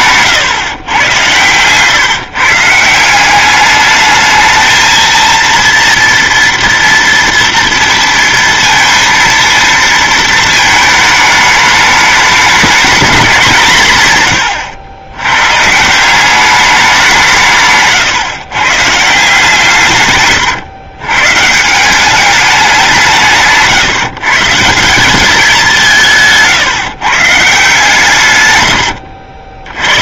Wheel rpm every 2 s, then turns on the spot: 130, 170, 220, 230, 230, 220, 210, 100, 200, 140, 110, 190, 160, 160, 110.
28-30